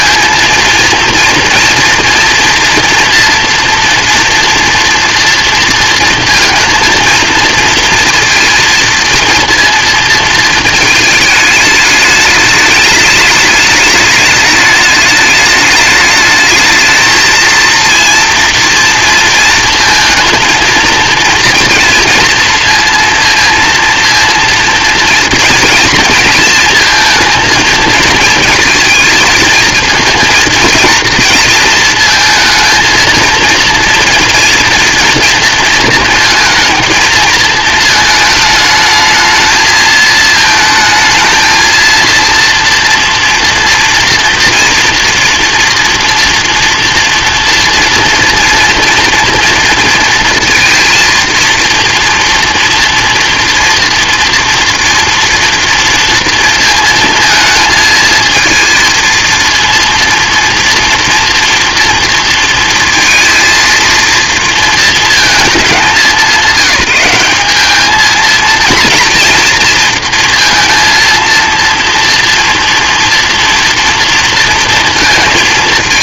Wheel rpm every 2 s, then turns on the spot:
230, 240, 240, 230, 230, 220, 210, 210, 220, 230, 230, 230, 230, 230, 220, 230, 230, 230, 220, 220, 220, 230, 230, 230, 230, 230, 230, 230, 230, 230, 230, 230, 230, 180, 230, 230, 230, 230.
none